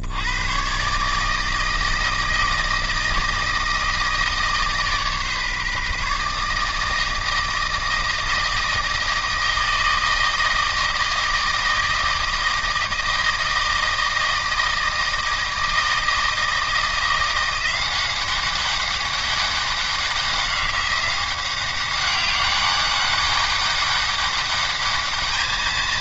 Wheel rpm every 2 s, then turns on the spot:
90, 160, 150, 150, 160, 160, 160, 160, 160, 190, 190, 200, 200.
none